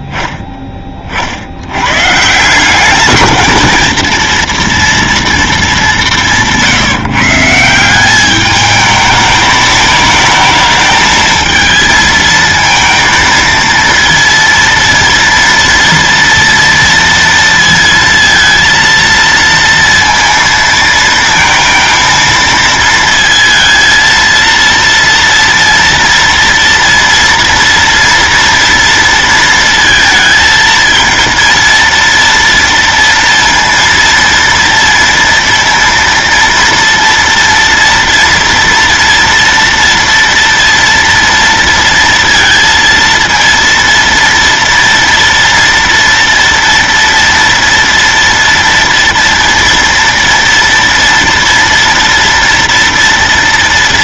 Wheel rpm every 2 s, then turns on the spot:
10, 170, 230, 170, 210, 220, 220, 230, 230, 230, 230, 230, 230, 230, 230, 220, 230, 230, 230, 230, 230, 230, 230, 230, 230, 230, 230.
none